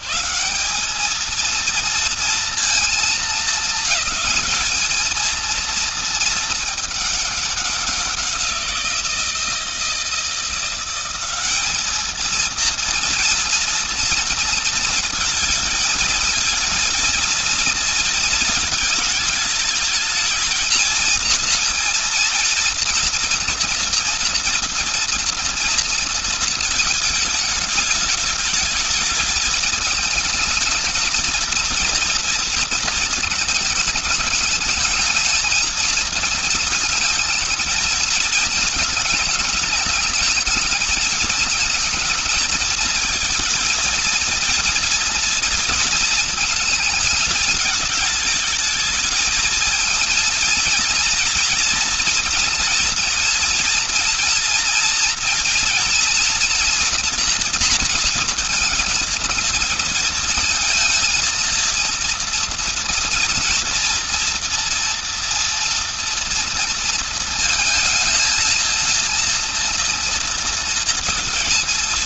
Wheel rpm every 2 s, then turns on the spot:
110, 230, 220, 220, 180, 160, 230, 240, 220, 230, 220, 230, 230, 230, 210, 220, 230, 210, 220, 220, 210, 220, 230, 230, 220, 230, 240, 230, 230, 230, 220, 240, 240, 230, 220, 230.
none